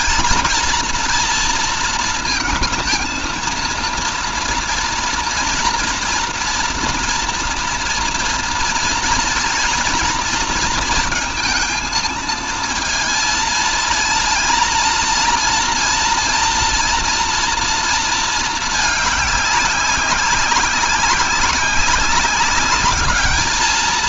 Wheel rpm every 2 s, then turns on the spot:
230, 220, 230, 230, 230, 230, 230, 230, 230, 210, 190, 200.
none